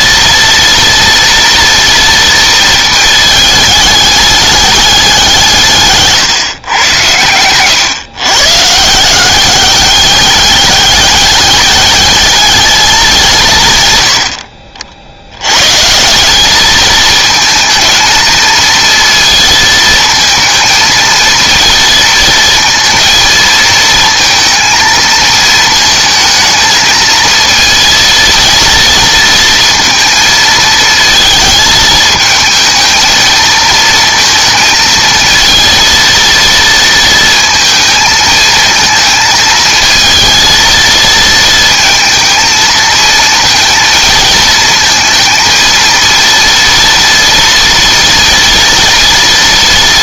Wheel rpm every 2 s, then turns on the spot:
230, 220, 200, 120, 160, 200, 210, 70, 220, 230, 230, 230, 230, 220, 230, 220, 220, 230, 230, 220, 230, 220, 220, 230, 230.
none